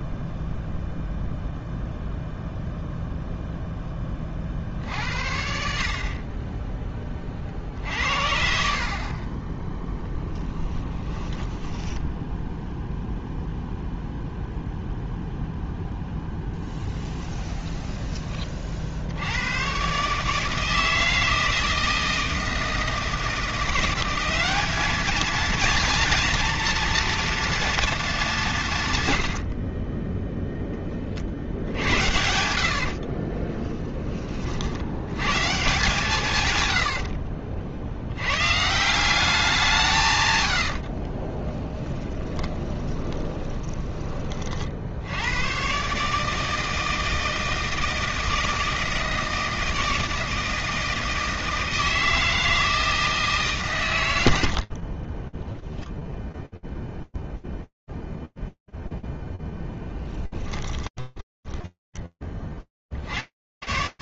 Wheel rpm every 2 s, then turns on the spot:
0, 0, 60, 20, 40, 20, 0, 0, 10, 70, 160, 170, 220, 230, 110, 40, 50, 110, 70, 170, 40, 20, 80, 160, 160, 160, 160, 30, 0, 10, 10, 70.
10-12 16-18 32-34 40-44 54-56 60-62